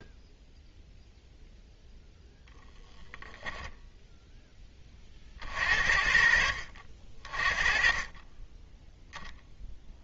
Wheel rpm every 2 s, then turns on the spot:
0, 0, 30, 50, 0.
none